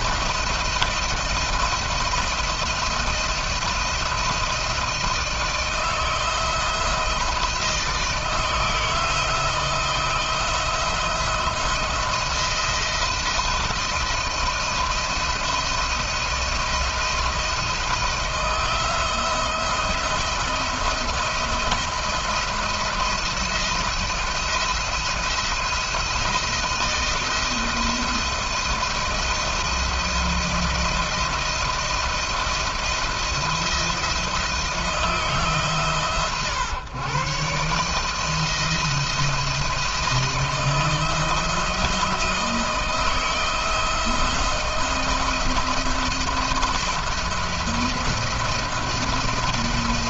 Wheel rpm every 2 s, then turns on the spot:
170, 170, 160, 160, 160, 170, 170, 170, 170, 170, 170, 170, 170, 160, 170, 170, 170, 160, 120, 160, 170, 160, 170, 170, 170.
none